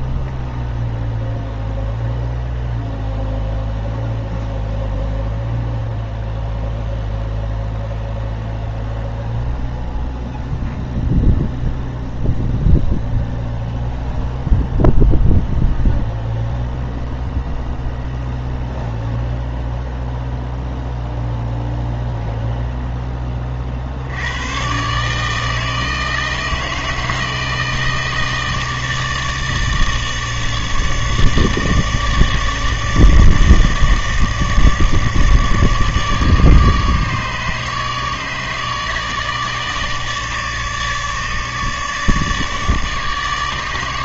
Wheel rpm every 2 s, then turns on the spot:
0, 0, 0, 0, 0, 0, 0, 0, 0, 0, 0, 0, 120, 160, 160, 150, 150, 160, 150, 150, 150, 150.
none